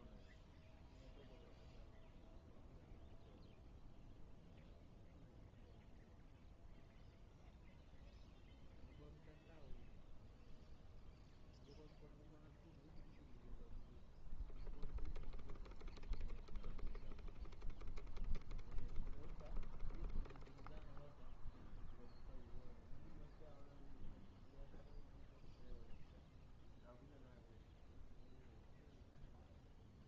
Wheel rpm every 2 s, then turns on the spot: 0, 0, 0, 0, 0, 0, 0, 0, 0, 0, 0, 0, 0, 0, 0.
none